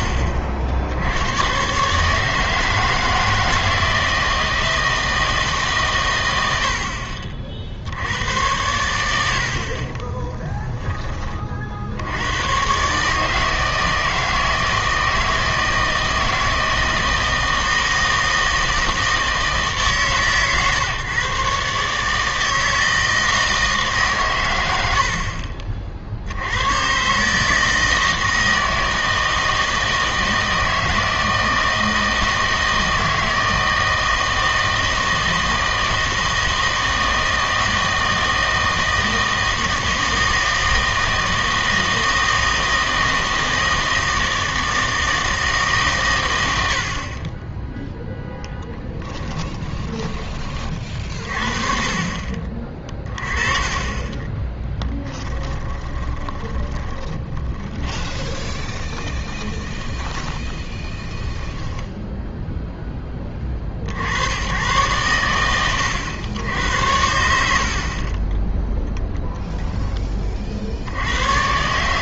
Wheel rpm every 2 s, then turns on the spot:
70, 160, 160, 70, 90, 10, 120, 160, 160, 160, 140, 160, 90, 100, 160, 160, 160, 160, 160, 160, 160, 160, 160, 70, 10, 30, 30, 10, 10, 20, 10, 10, 110, 90, 0, 60.
48-50 54-62